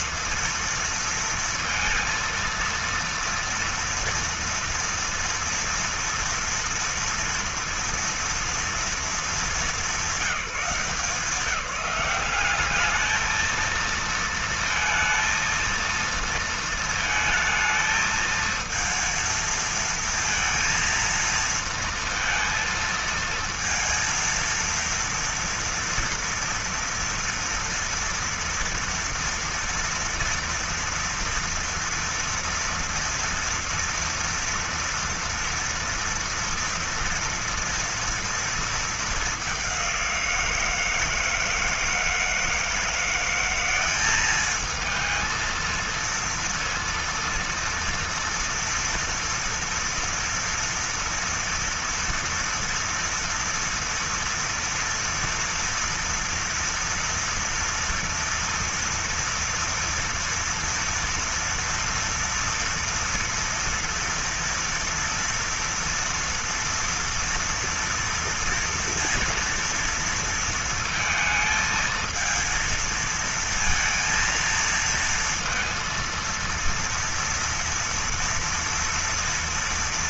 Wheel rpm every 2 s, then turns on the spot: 230, 230, 230, 230, 220, 170, 200, 230, 230, 220, 230, 230, 230, 230, 230, 240, 240, 240, 230, 220, 170, 170, 210, 230, 240, 230, 230, 230, 230, 230, 230, 230, 230, 230, 230, 230, 230, 230, 230, 230.
none